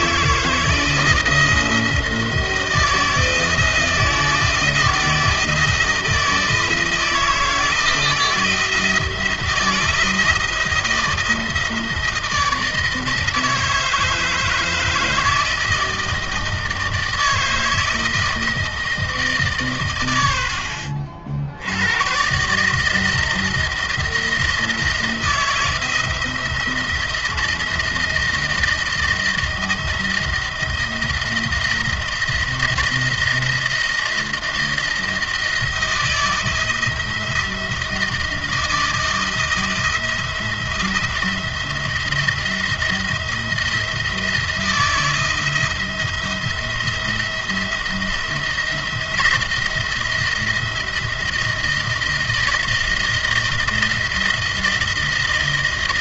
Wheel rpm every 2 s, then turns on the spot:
160, 160, 160, 160, 170, 170, 160, 160, 160, 160, 70, 160, 170, 170, 170, 170, 170, 170, 160, 160, 170, 170, 170, 170, 170, 170, 170, 160.
none